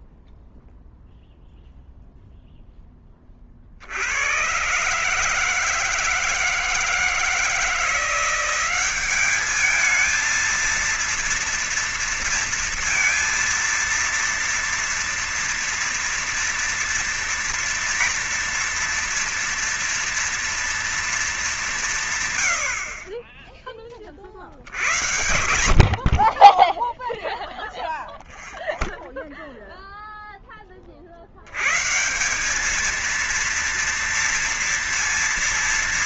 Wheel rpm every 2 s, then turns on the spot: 0, 0, 110, 160, 180, 220, 230, 230, 230, 240, 240, 120, 50, 30, 0, 10, 180, 230.
none